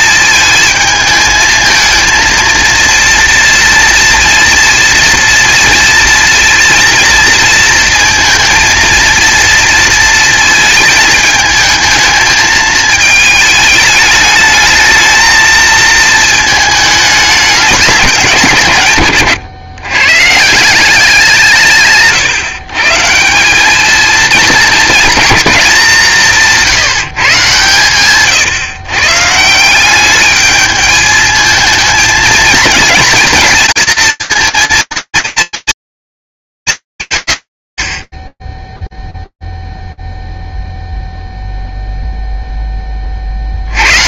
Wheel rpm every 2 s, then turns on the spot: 220, 230, 230, 230, 230, 220, 220, 220, 210, 130, 170, 150, 220, 170, 140, 210, 230, 230, 180, 0, 0, 0.
none